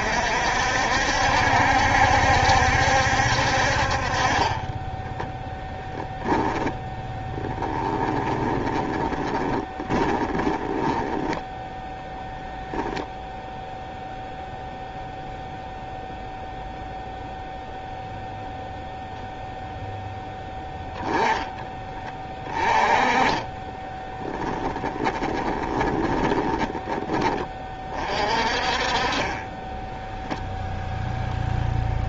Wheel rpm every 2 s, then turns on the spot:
60, 70, 20, 10, 20, 20, 0, 0, 0, 0, 10, 20, 10, 20, 40, 0.
4-12 24-28